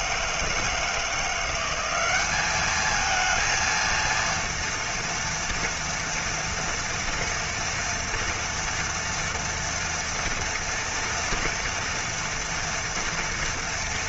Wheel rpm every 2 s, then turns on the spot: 160, 200, 230, 230, 230, 230, 230.
none